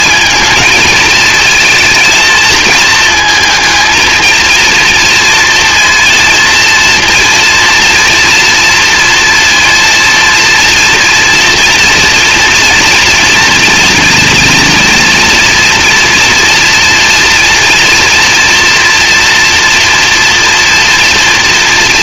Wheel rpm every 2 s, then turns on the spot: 220, 220, 230, 230, 230, 230, 230, 240, 230, 240, 230.
none